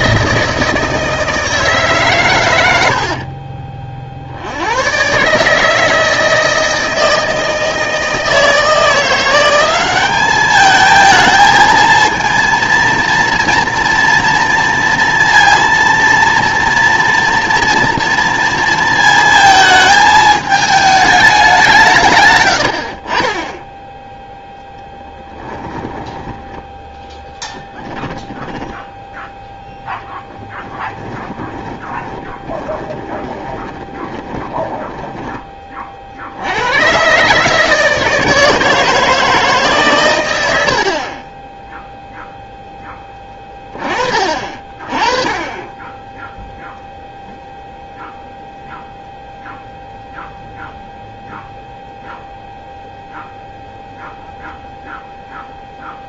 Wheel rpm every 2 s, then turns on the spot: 160, 100, 90, 160, 170, 210, 230, 230, 240, 230, 220, 80, 0, 10, 10, 10, 20, 10, 100, 160, 70, 10, 30, 0, 0, 0, 0, 0.
22-24 28-36